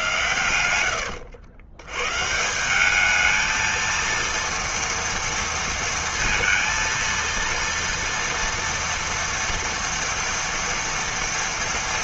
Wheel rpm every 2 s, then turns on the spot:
130, 170, 230, 230, 230, 240.
none